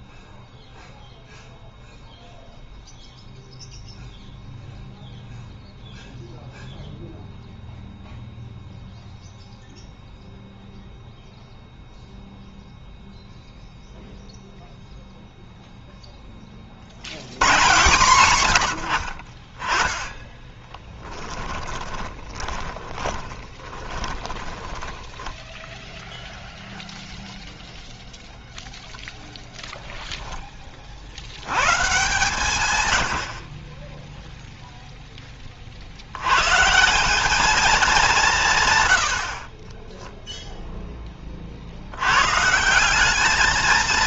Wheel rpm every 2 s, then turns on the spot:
0, 0, 0, 0, 0, 0, 0, 0, 40, 90, 20, 20, 10, 0, 0, 0, 130, 0, 110, 160, 0, 130.
20-26